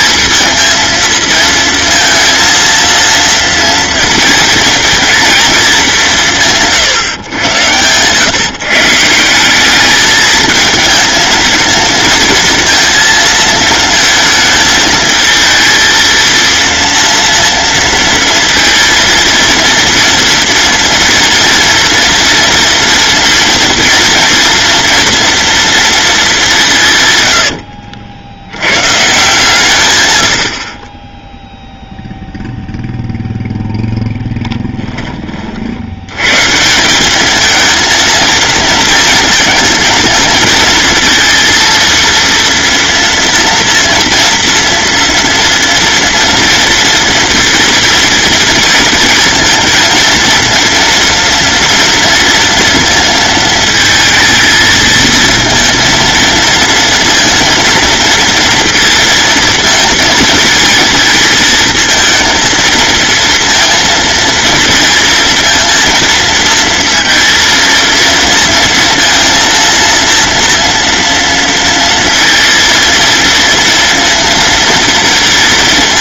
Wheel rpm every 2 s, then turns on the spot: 220, 230, 230, 140, 160, 220, 230, 220, 230, 230, 230, 230, 230, 150, 130, 20, 0, 20, 180, 230, 230, 230, 230, 230, 230, 230, 230, 220, 230, 230, 230, 220, 230, 230, 230, 230, 230, 230.
none